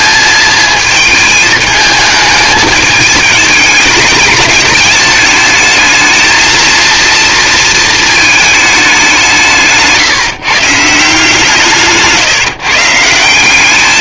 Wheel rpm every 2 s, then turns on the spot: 220, 210, 210, 230, 220, 150, 150.
none